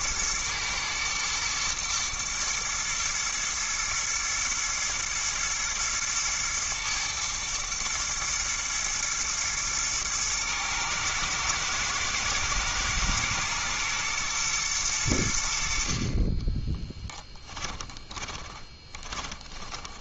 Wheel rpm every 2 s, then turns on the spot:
110, 110, 120, 110, 110, 120, 120, 110, 20, 20.
16-20